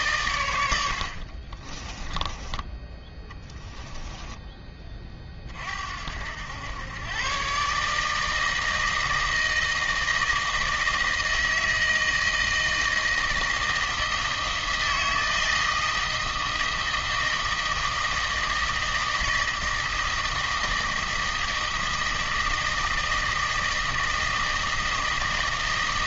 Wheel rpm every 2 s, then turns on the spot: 100, 20, 20, 100, 160, 160, 160, 160, 160, 160, 160, 160, 160.
none